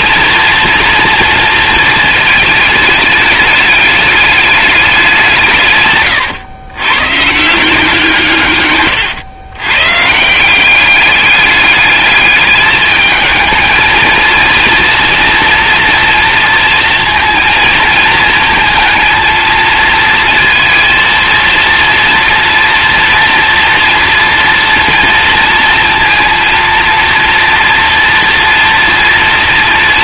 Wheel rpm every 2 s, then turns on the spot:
240, 210, 200, 120, 130, 190, 210, 230, 230, 230, 230, 240, 230, 230, 240.
8-10